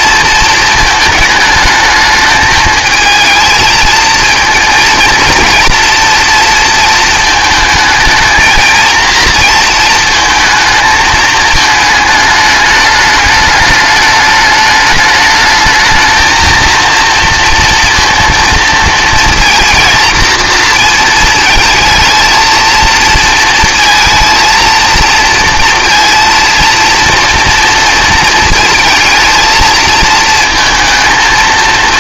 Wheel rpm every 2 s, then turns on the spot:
220, 220, 230, 230, 220, 220, 210, 210, 220, 230, 230, 230, 230, 230, 220, 230.
none